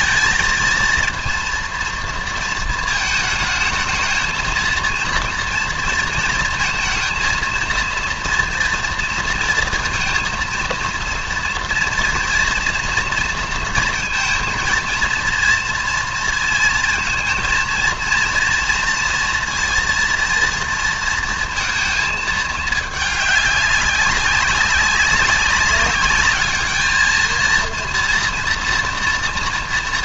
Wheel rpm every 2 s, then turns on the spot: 230, 220, 230, 230, 230, 230, 230, 230, 230, 230, 230, 220, 190, 220, 230.
none